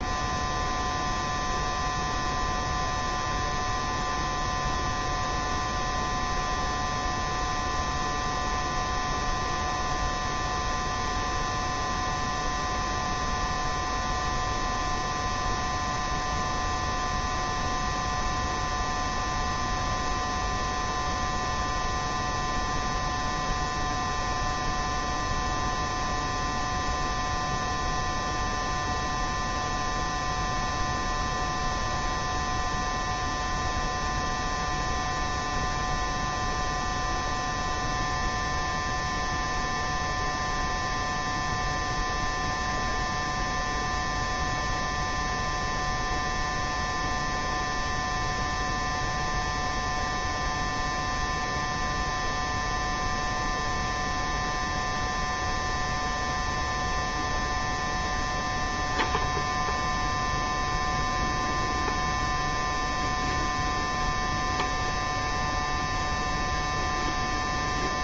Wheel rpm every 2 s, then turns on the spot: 0, 0, 0, 0, 0, 0, 0, 0, 0, 0, 0, 0, 0, 0, 0, 0, 0, 0, 0, 0, 0, 0, 0, 0, 0, 0, 0, 0, 0, 0, 0, 0, 0, 0.
none